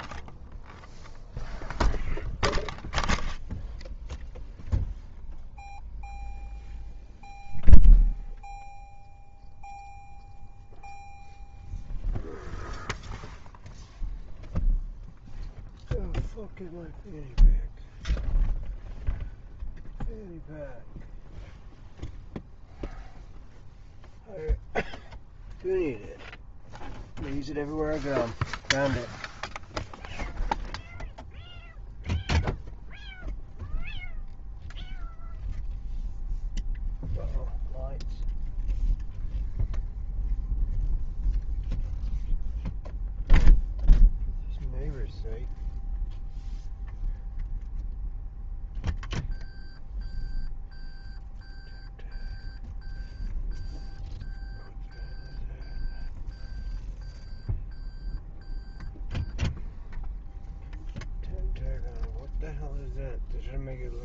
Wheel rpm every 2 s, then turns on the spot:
0, 0, 0, 0, 0, 0, 0, 0, 0, 0, 0, 0, 0, 0, 0, 0, 0, 0, 0, 0, 0, 0, 0, 0, 0, 0, 0, 0, 0, 0, 0, 0.
none